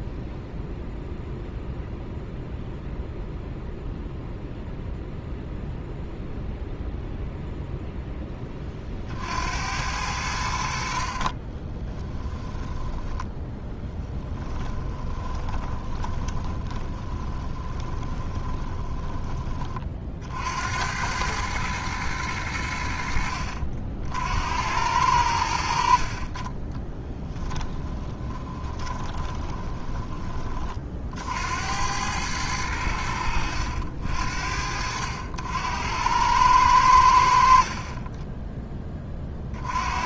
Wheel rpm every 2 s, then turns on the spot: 0, 0, 0, 0, 30, 70, 10, 10, 20, 20, 80, 80, 80, 20, 20, 40, 90, 60, 90, 10.
14-20 26-30